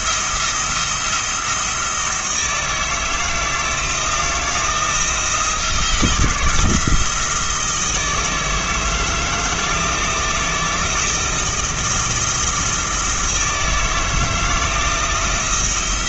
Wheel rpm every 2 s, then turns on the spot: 170, 160, 170, 160, 160, 160, 170, 160.
none